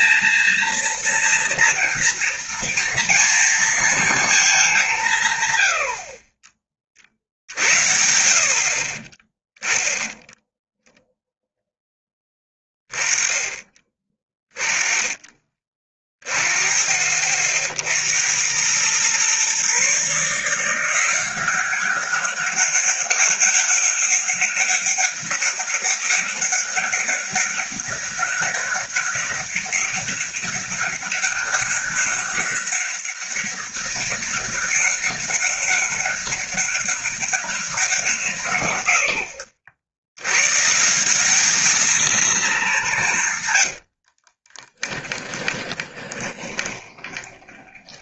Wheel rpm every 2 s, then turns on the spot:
240, 230, 180, 30, 40, 0, 20, 20, 40, 110, 170, 200, 200, 200, 200, 200, 200, 200, 200, 110, 180, 200, 10, 20.
44-48